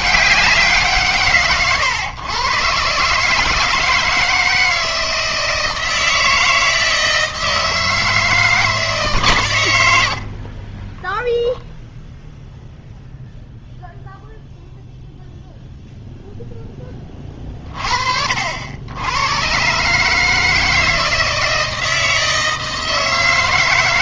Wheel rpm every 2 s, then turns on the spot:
180, 130, 160, 160, 160, 40, 0, 0, 10, 80, 160, 160.
none